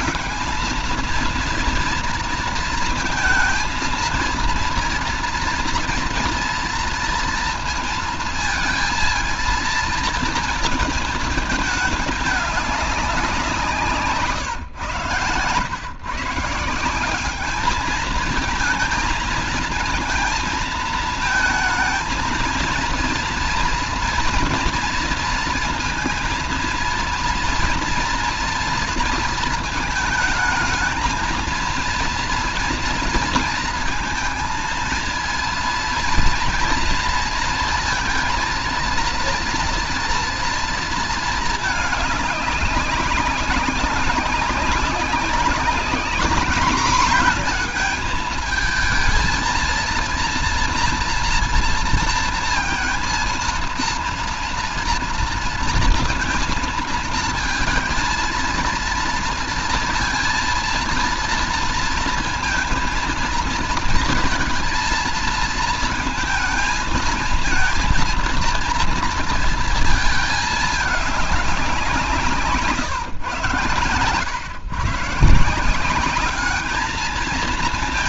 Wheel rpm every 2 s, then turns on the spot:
220, 230, 230, 230, 230, 230, 210, 150, 150, 220, 230, 230, 230, 230, 230, 220, 230, 220, 230, 230, 230, 200, 200, 210, 220, 240, 230, 240, 230, 230, 230, 230, 230, 220, 230, 220, 170, 130, 210.
72-74